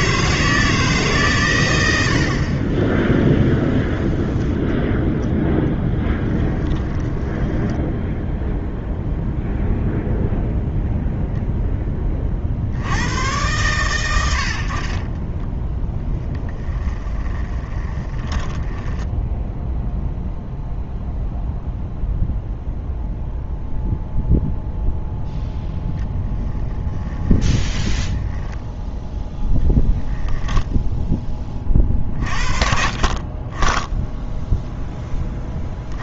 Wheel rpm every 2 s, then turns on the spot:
160, 30, 0, 20, 0, 0, 70, 60, 10, 10, 0, 0, 0, 10, 0, 0, 40, 0.
6-8 16-20